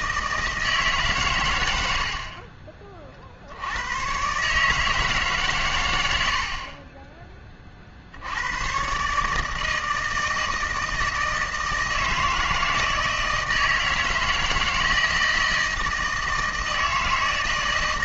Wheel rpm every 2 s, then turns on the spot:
160, 40, 150, 40, 110, 160, 160, 160, 160.
none